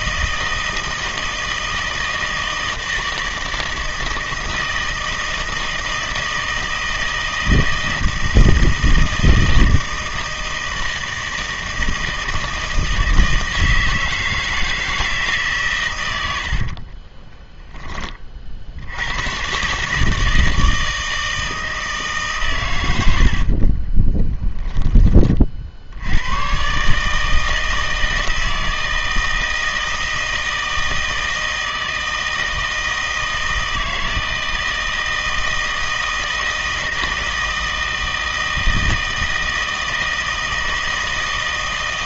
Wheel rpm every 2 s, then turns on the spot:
160, 160, 160, 160, 160, 160, 160, 160, 50, 60, 160, 110, 10, 140, 160, 160, 160, 160, 160, 160, 160.
16-18